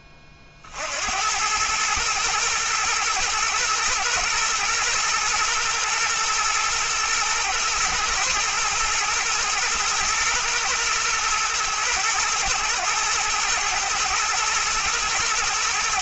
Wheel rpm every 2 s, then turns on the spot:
50, 110, 120, 110, 120, 110, 110, 110.
none